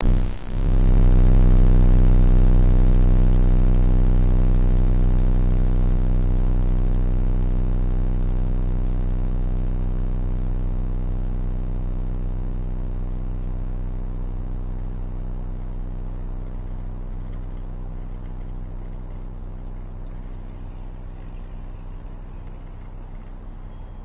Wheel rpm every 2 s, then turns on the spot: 0, 0, 0, 0, 0, 0, 0, 0, 0, 0, 0, 0.
none